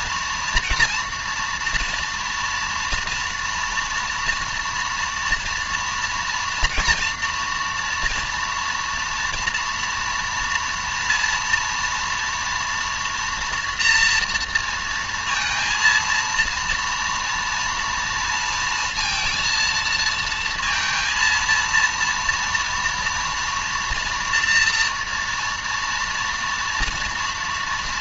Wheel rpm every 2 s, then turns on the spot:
230, 230, 230, 240, 230, 230, 230, 230, 230, 230, 230, 230, 230, 230.
none